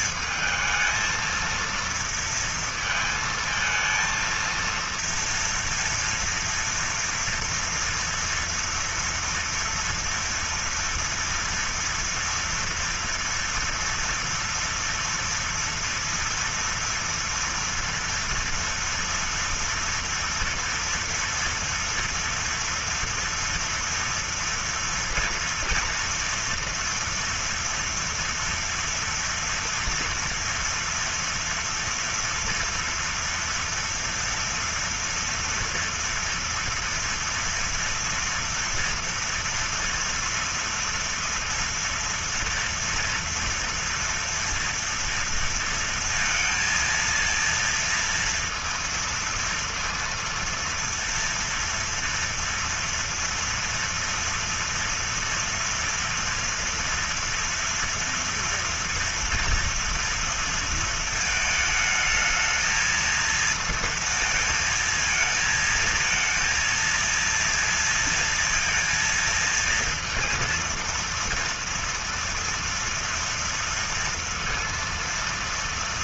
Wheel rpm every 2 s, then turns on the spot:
220, 230, 230, 230, 230, 240, 230, 230, 230, 230, 230, 230, 230, 230, 230, 230, 240, 230, 230, 230, 230, 230, 230, 230, 230, 230, 230, 240, 230, 240, 230, 220, 230, 230, 230, 230, 230, 230.
none